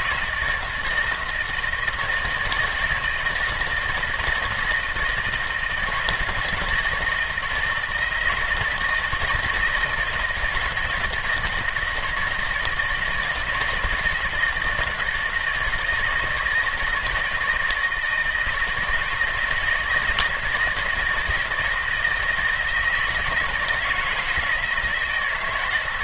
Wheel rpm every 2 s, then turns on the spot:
160, 160, 170, 160, 160, 160, 160, 160, 170, 160, 160, 160, 160.
none